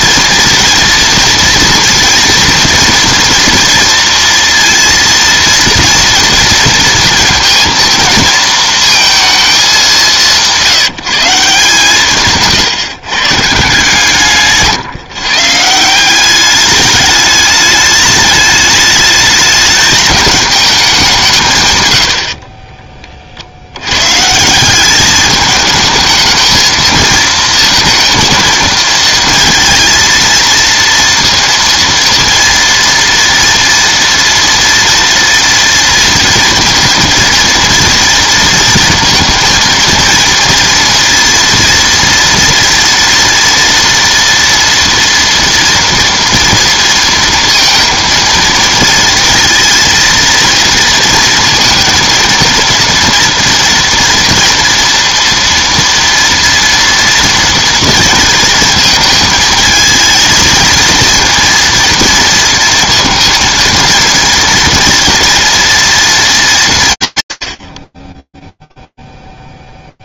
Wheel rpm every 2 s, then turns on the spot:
230, 230, 230, 230, 220, 170, 130, 140, 210, 210, 190, 30, 190, 220, 230, 230, 230, 230, 230, 230, 230, 240, 230, 230, 230, 230, 230, 230, 240, 220, 230, 230, 240, 160, 0.
none